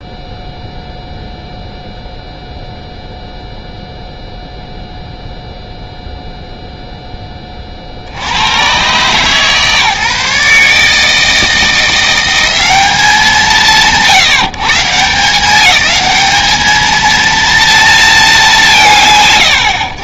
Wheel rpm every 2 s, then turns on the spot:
0, 0, 0, 0, 90, 140, 170, 150, 210, 170.
none